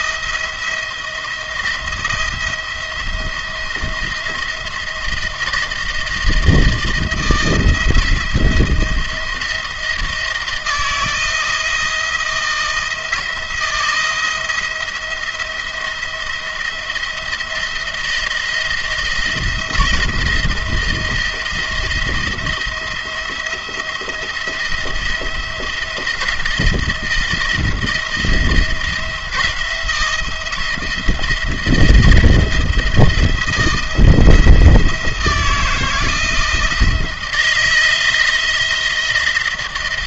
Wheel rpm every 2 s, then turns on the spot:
170, 170, 170, 170, 170, 160, 160, 170, 170, 170, 170, 170, 170, 170, 170, 170, 160, 170, 170, 170.
none